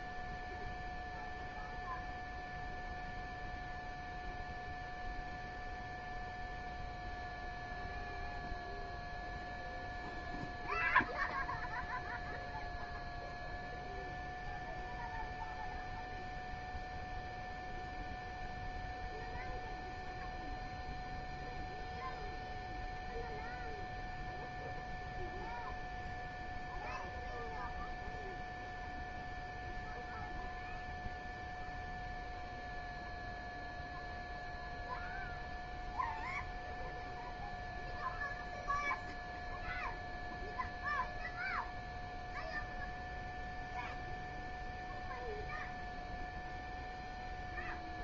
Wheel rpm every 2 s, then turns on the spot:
0, 0, 0, 0, 0, 0, 0, 0, 0, 0, 0, 0, 0, 0, 0, 0, 0, 0, 0, 0, 0, 0, 0, 0.
none